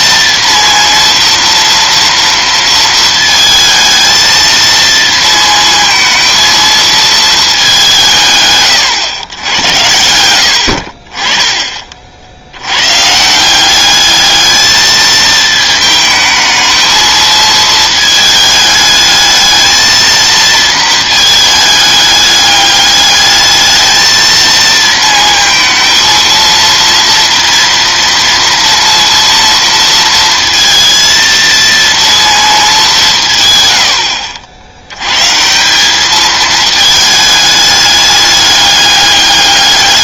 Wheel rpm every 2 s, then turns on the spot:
230, 230, 230, 220, 120, 50, 110, 220, 220, 220, 230, 210, 220, 230, 230, 230, 200, 80, 220, 200.
none